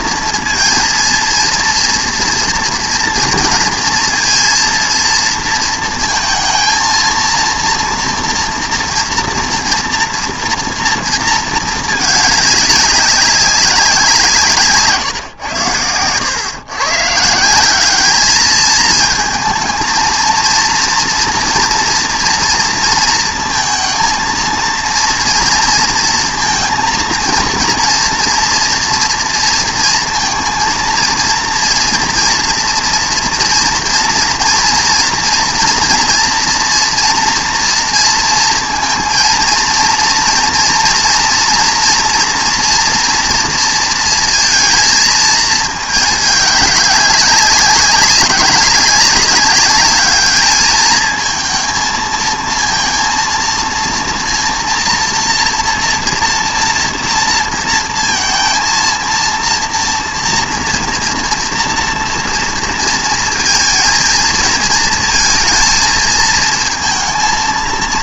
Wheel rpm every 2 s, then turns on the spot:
230, 230, 230, 230, 240, 230, 200, 140, 130, 220, 230, 230, 230, 240, 230, 230, 230, 230, 230, 230, 230, 230, 230, 200, 200, 220, 230, 230, 230, 230, 230, 230, 220, 230.
14-16